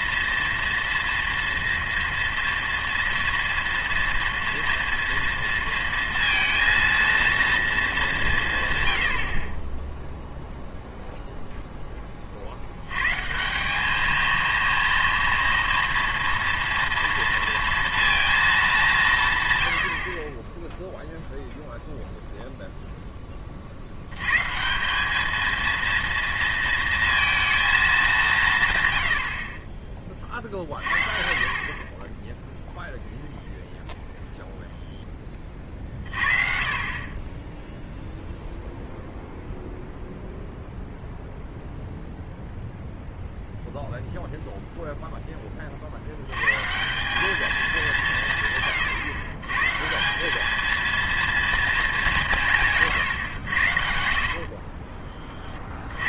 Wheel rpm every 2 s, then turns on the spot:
230, 230, 230, 230, 130, 0, 80, 230, 230, 200, 10, 0, 170, 230, 130, 40, 0, 0, 30, 0, 0, 0, 0, 150, 140, 220, 150, 30.
none